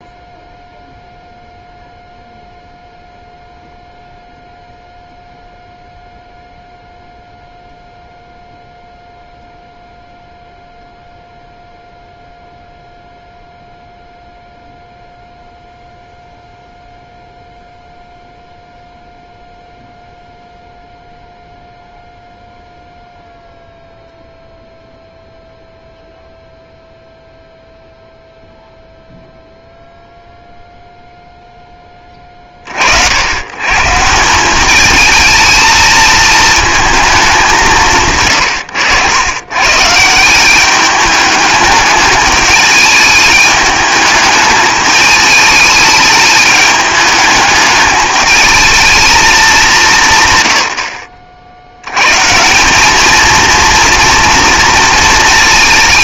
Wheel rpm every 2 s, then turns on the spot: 0, 0, 0, 0, 0, 0, 0, 0, 0, 0, 0, 0, 0, 0, 0, 0, 40, 190, 220, 120, 190, 210, 210, 210, 220, 130, 170, 230.
none